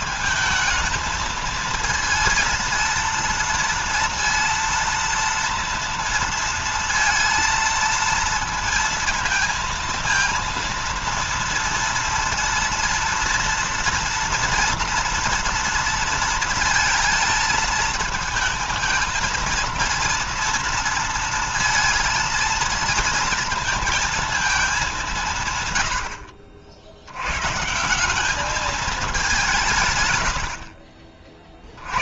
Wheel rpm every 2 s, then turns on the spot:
220, 230, 230, 230, 230, 230, 230, 230, 230, 230, 230, 220, 210, 60, 210, 70.
none